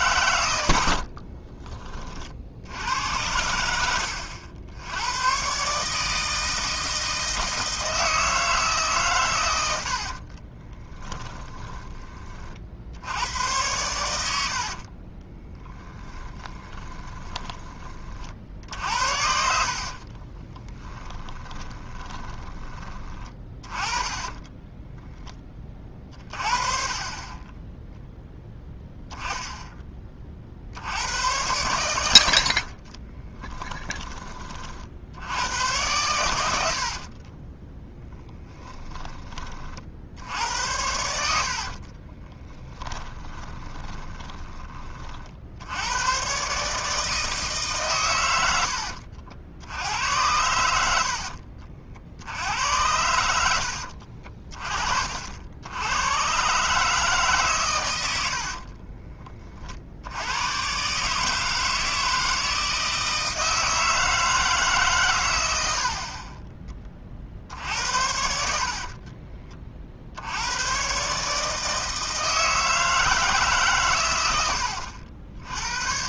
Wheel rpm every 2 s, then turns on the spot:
70, 70, 100, 160, 140, 20, 70, 40, 20, 60, 20, 20, 10, 30, 10, 80, 40, 50, 60, 20, 80, 20, 30, 150, 80, 70, 90, 40, 150, 40, 130, 160, 140, 30, 40, 130, 160, 80.
0-2 10-12 14-22 24-26 32-34 36-40 42-44 58-60 68-70